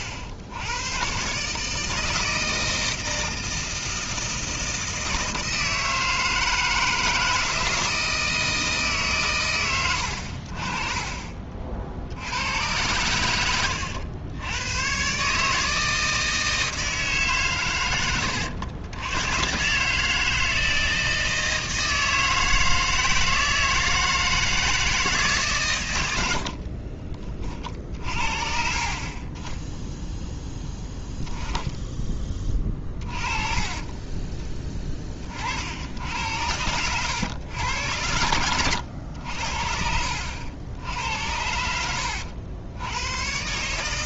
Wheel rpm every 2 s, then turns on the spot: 110, 160, 160, 160, 150, 30, 100, 110, 160, 100, 160, 160, 160, 40, 50, 10, 30, 20, 90, 90, 80, 90.
26-28 32-34 36-38